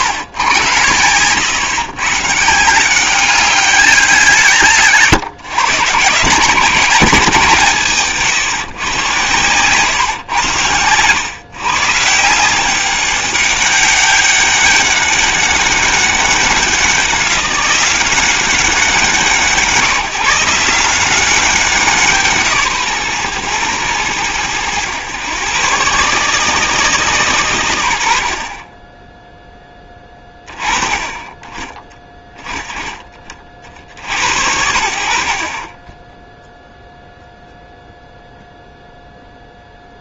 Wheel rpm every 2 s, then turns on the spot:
110, 150, 160, 170, 140, 110, 180, 200, 190, 180, 170, 150, 90, 150, 40, 20, 10, 70, 0, 0.
none